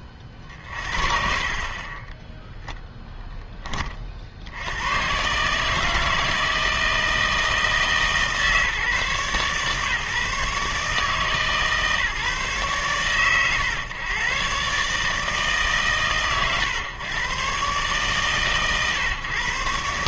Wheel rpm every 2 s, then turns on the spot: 30, 0, 90, 160, 150, 150, 120, 130, 130, 120.
none